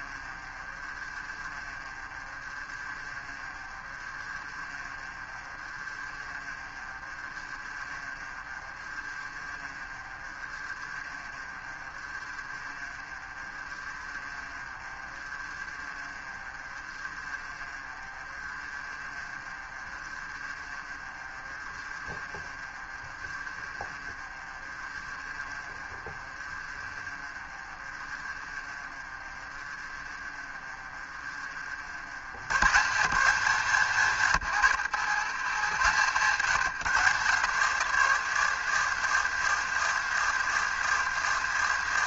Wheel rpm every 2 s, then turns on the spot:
40, 30, 30, 30, 30, 30, 30, 30, 30, 30, 30, 30, 30, 40, 30, 30, 150, 120, 150, 140, 150.
0-32